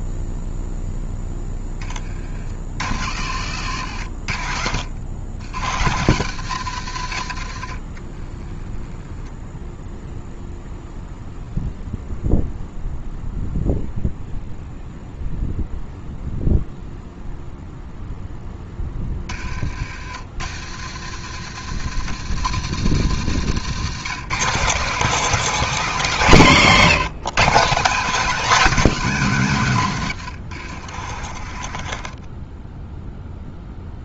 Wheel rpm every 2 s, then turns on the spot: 0, 40, 80, 110, 20, 0, 0, 0, 0, 30, 100, 140, 220, 170, 200, 50, 0.
22-24